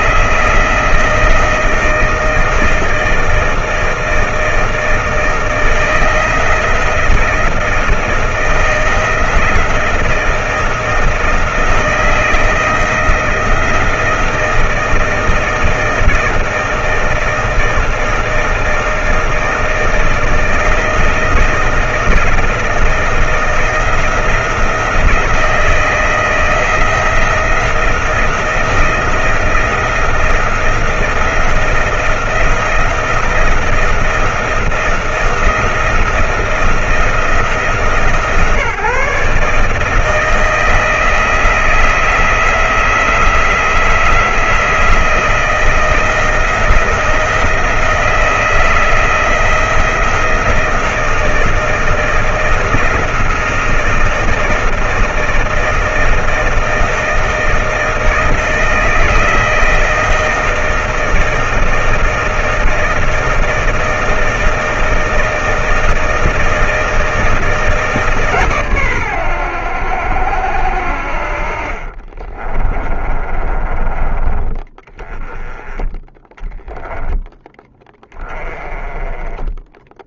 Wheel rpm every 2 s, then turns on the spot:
160, 160, 170, 160, 160, 160, 170, 170, 160, 160, 160, 170, 170, 160, 170, 170, 170, 170, 170, 160, 160, 160, 160, 160, 170, 160, 160, 160, 160, 160, 160, 160, 160, 160, 130, 70, 30, 20, 10, 20.
72-74